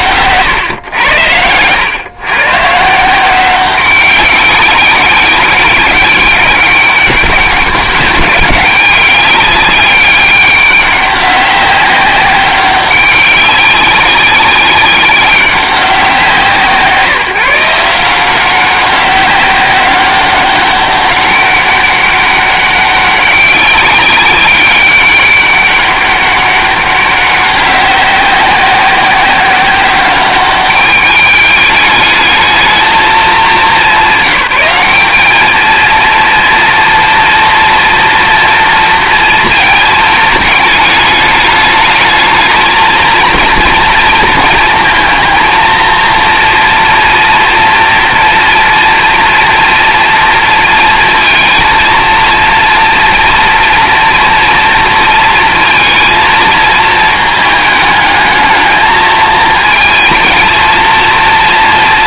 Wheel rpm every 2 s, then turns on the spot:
120, 140, 190, 200, 200, 200, 190, 190, 150, 190, 200, 190, 190, 200, 190, 200, 220, 190, 230, 230, 210, 220, 230, 230, 230, 230, 230, 230, 220, 220, 220.
0-2